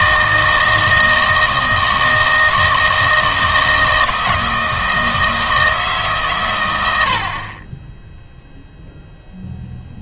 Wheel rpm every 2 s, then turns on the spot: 160, 160, 160, 110, 0.
none